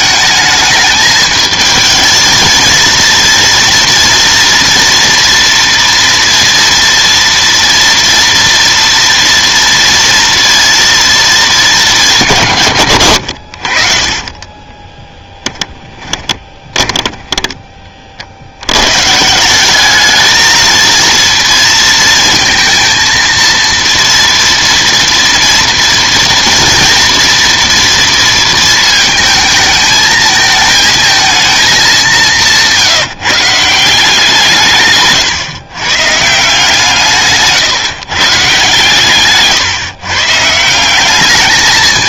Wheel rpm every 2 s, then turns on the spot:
210, 230, 230, 230, 230, 230, 120, 20, 20, 100, 220, 230, 230, 230, 230, 220, 170, 150, 160, 140, 180.
14-18